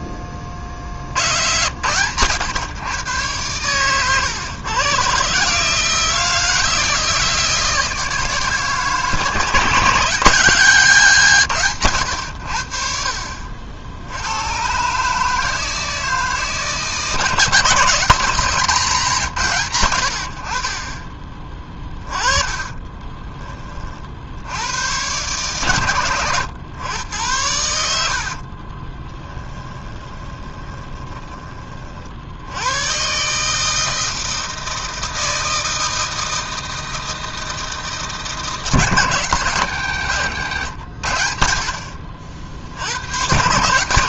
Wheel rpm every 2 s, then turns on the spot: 40, 120, 110, 160, 160, 170, 70, 120, 160, 170, 50, 20, 80, 110, 40, 20, 100, 160, 160, 150, 110, 70.
22-24 28-32 40-42